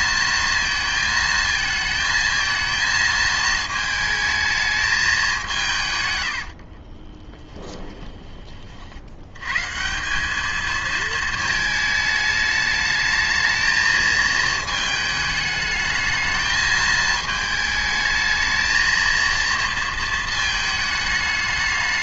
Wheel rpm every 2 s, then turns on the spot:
220, 220, 210, 30, 60, 220, 220, 220, 220, 230, 220.
6-8